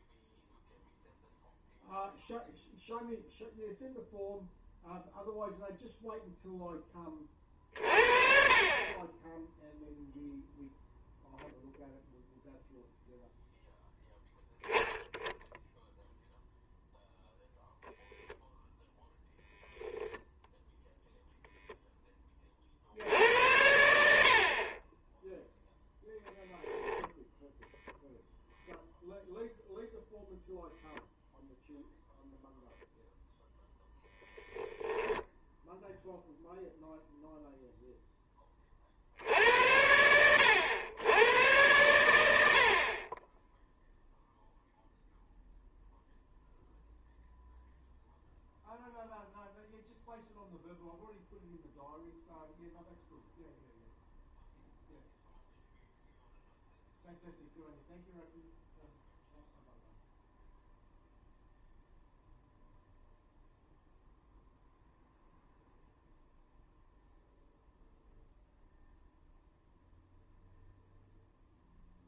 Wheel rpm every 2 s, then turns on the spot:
0, 0, 0, 10, 30, 0, 0, 10, 0, 0, 0, 60, 30, 0, 0, 0, 0, 0, 0, 50, 100, 50, 0, 0, 0, 0, 0, 0, 0, 0, 0, 0, 0, 0, 0, 0.
none